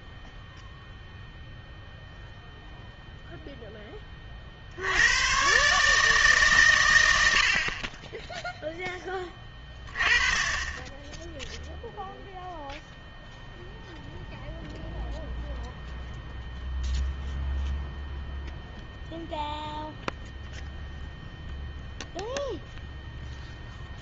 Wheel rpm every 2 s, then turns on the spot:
0, 0, 70, 120, 10, 10, 0, 0, 0, 0, 0, 0.
none